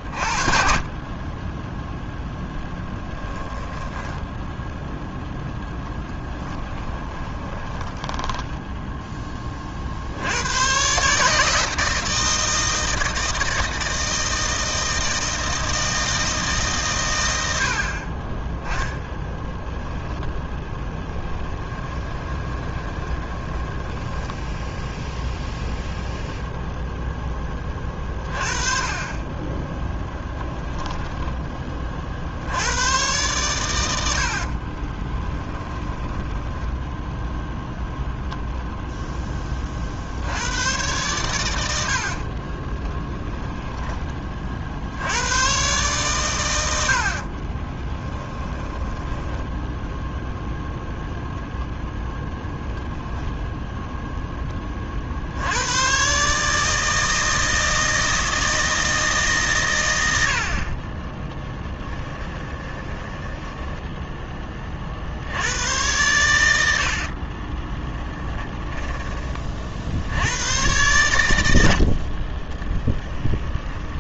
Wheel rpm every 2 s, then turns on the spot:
40, 0, 0, 20, 10, 120, 160, 160, 140, 10, 10, 20, 0, 0, 30, 10, 100, 30, 10, 0, 110, 20, 70, 80, 10, 10, 0, 40, 160, 160, 30, 10, 40, 70, 20, 110, 20.
6-10 20-24 34-36 42-44 48-50 60-64 66-70 72-74